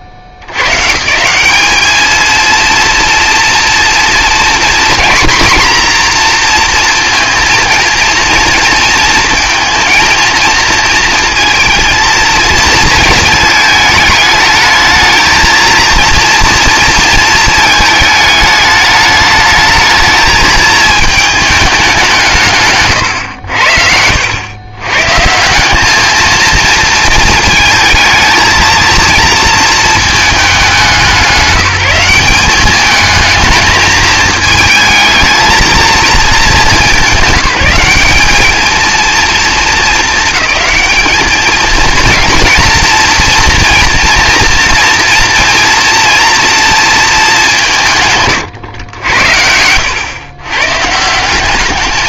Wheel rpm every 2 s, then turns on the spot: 120, 220, 230, 230, 230, 230, 220, 220, 240, 210, 220, 140, 110, 220, 230, 200, 200, 220, 190, 210, 220, 230, 230, 230, 110, 120.
none